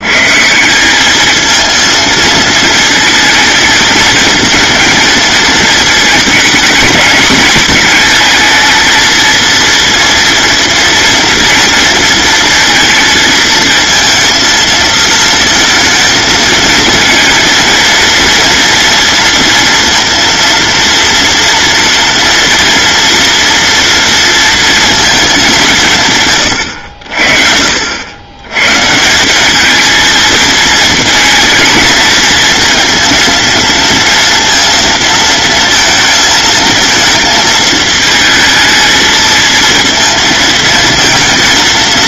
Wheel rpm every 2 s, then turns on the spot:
190, 220, 220, 210, 220, 240, 230, 220, 230, 230, 230, 230, 220, 70, 140, 230, 230, 230, 220, 220, 230.
none